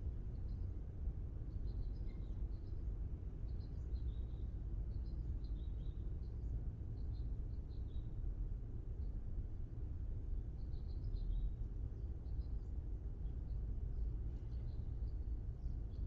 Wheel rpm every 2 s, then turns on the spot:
0, 0, 0, 0, 0, 0, 0, 0.
none